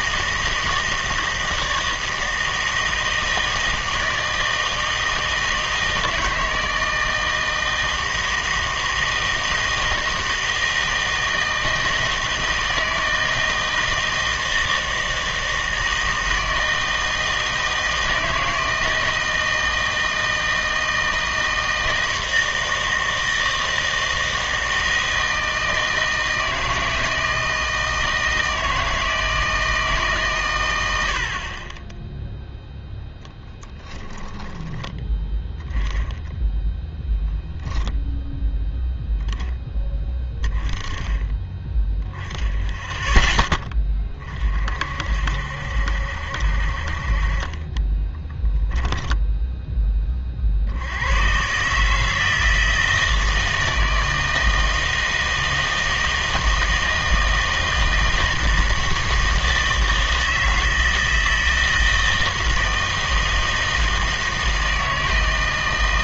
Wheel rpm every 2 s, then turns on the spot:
160, 160, 160, 160, 160, 160, 160, 160, 160, 160, 160, 160, 160, 160, 160, 120, 0, 10, 10, 0, 20, 10, 50, 50, 10, 50, 160, 160, 160, 160, 160, 160, 160.
34-36 48-50